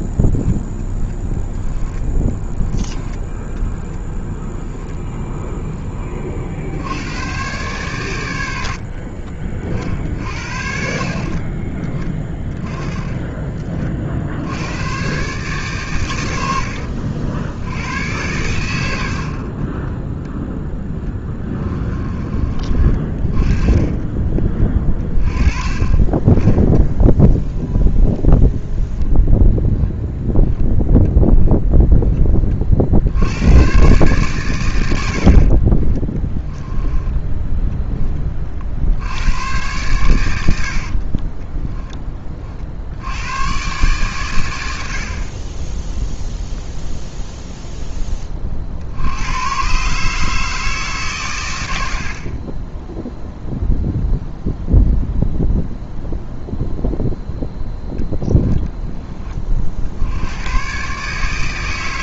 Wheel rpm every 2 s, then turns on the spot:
0, 10, 0, 60, 80, 50, 20, 100, 80, 90, 10, 30, 20, 10, 0, 10, 50, 100, 20, 70, 40, 60, 90, 0, 60, 150, 10, 0, 0, 10, 120.
2-4 16-18 36-38 40-42